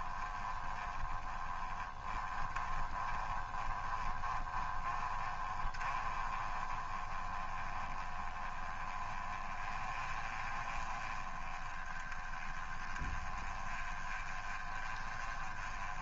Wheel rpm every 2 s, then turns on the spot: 20, 20, 20, 20, 20, 20, 20, 20.
none